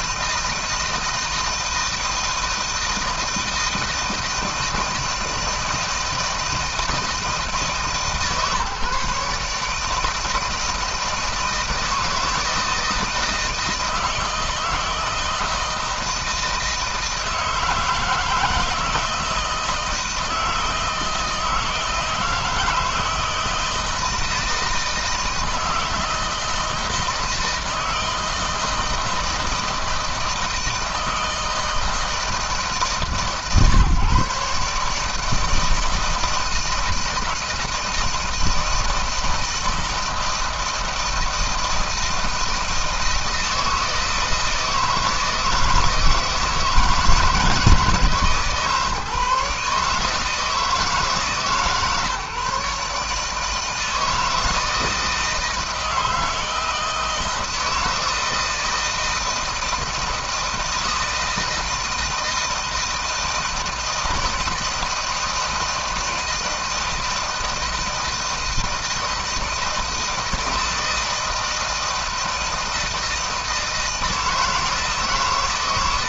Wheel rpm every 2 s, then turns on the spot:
160, 160, 160, 160, 140, 160, 160, 160, 160, 160, 160, 160, 160, 160, 160, 160, 150, 150, 160, 160, 160, 160, 160, 160, 150, 160, 150, 160, 160, 160, 160, 160, 160, 160, 160, 160, 160, 150.
none